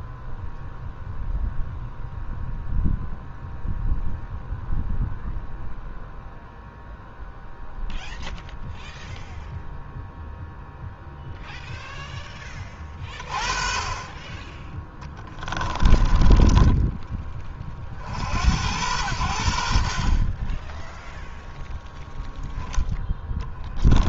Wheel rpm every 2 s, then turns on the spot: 0, 0, 0, 0, 0, 0, 20, 20, 10, 90, 10, 10.
14-16 22-24